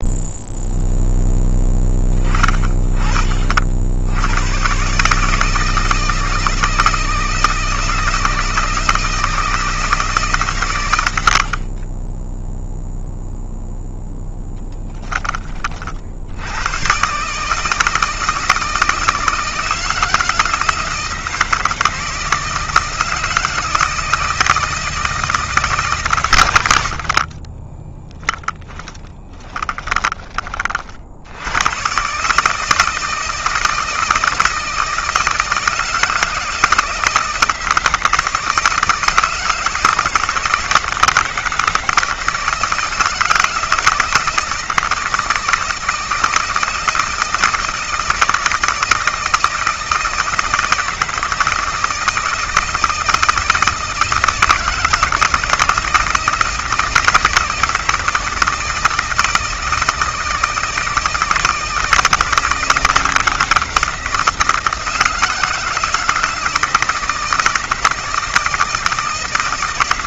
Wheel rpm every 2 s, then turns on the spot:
0, 30, 140, 160, 160, 110, 0, 10, 120, 160, 160, 160, 160, 50, 20, 60, 160, 160, 160, 160, 160, 160, 160, 160, 160, 160, 160, 160, 160, 160, 160, 170, 160, 160, 160.
10-12 26-30